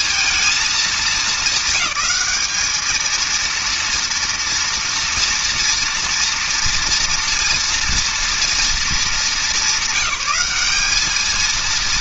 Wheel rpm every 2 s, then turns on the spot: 230, 200, 230, 230, 230, 200.
none